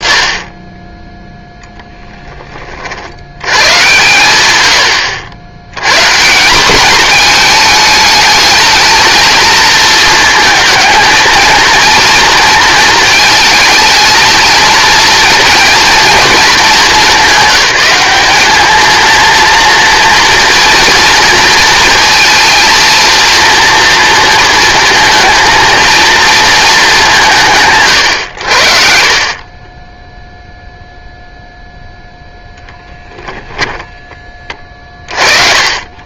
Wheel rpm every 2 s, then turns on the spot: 20, 30, 100, 190, 220, 230, 230, 230, 210, 210, 230, 230, 230, 220, 60, 0, 0, 30.
none